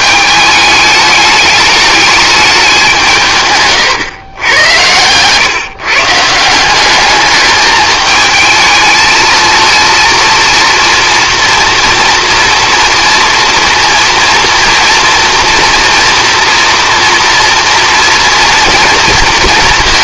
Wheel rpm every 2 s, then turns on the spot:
210, 190, 100, 190, 220, 230, 230, 240, 230, 230.
4-6